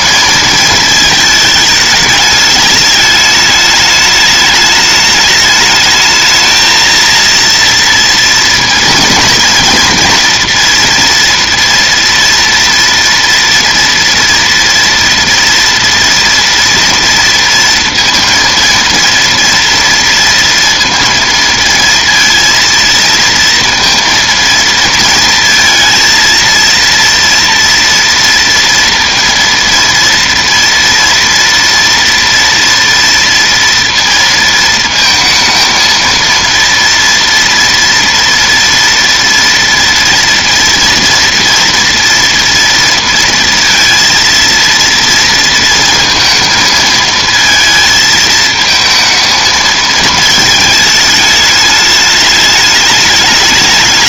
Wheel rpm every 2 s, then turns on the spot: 220, 210, 210, 220, 230, 240, 230, 230, 230, 230, 230, 230, 230, 230, 230, 230, 230, 220, 230, 230, 230, 230, 230, 220, 220, 220, 210.
none